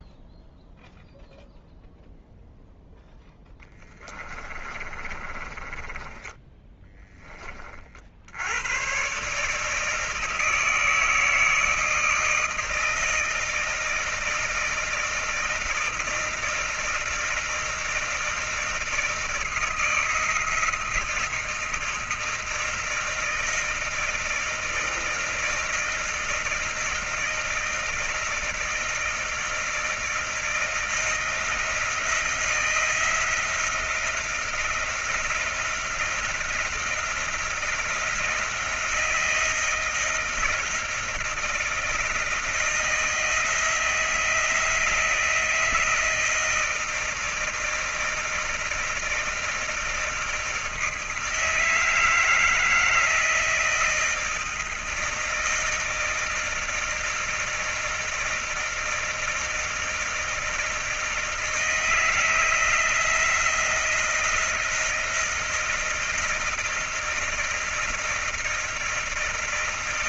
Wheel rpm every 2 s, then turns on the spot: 0, 0, 20, 20, 80, 160, 160, 160, 160, 160, 160, 160, 160, 160, 160, 160, 170, 170, 170, 170, 160, 170, 170, 160, 160, 160, 160, 160, 160, 160, 160, 160, 170, 160, 170.
4-8